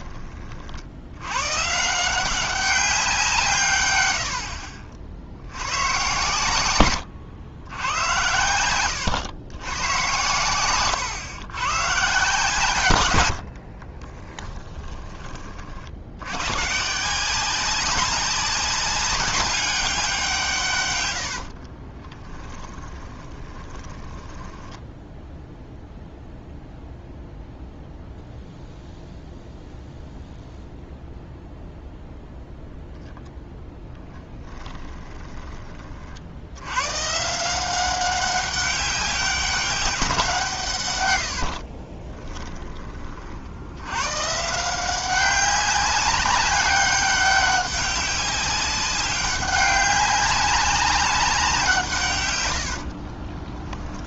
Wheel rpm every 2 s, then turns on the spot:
60, 190, 50, 110, 110, 120, 130, 20, 150, 190, 130, 20, 10, 0, 0, 0, 0, 10, 110, 190, 140, 20, 180, 200, 200, 200, 70.
8-10 14-16 22-26 34-36 52-54